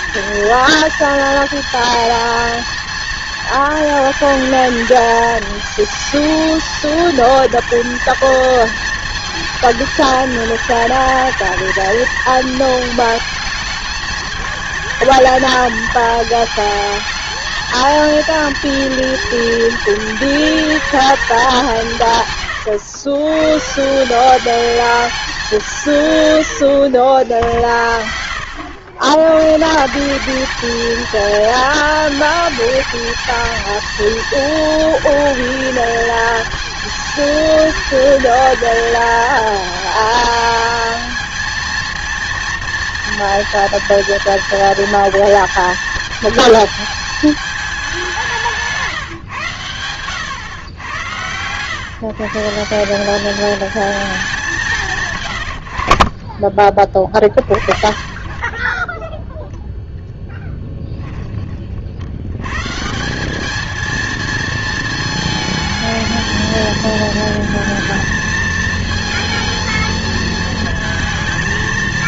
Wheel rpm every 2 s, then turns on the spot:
230, 230, 220, 220, 230, 220, 220, 220, 220, 230, 220, 110, 210, 80, 90, 220, 220, 220, 220, 220, 220, 230, 230, 220, 160, 110, 170, 170, 30, 20, 10, 140, 220, 220, 220, 230.
48-50 60-62